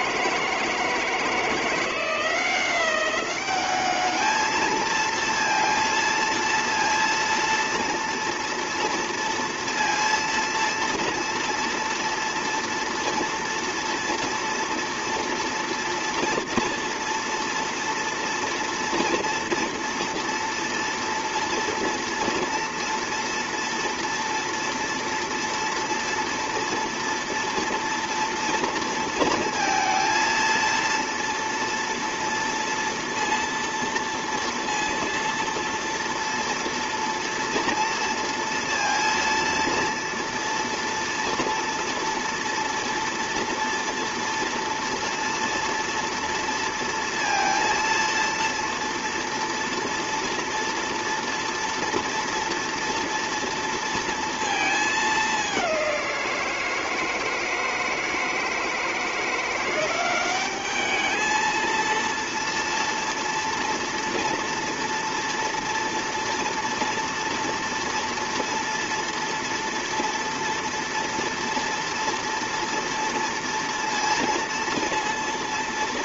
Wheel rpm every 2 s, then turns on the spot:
160, 180, 220, 230, 230, 230, 230, 230, 230, 230, 230, 230, 230, 230, 230, 230, 230, 230, 230, 230, 230, 240, 230, 230, 230, 230, 230, 220, 170, 160, 210, 230, 240, 230, 230, 230, 230, 230.
none